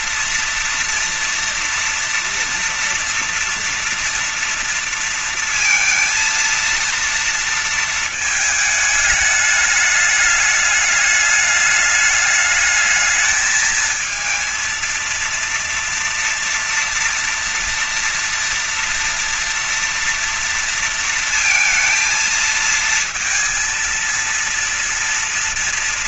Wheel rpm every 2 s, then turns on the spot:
230, 230, 230, 230, 220, 210, 210, 230, 230, 240, 230, 230, 230.
none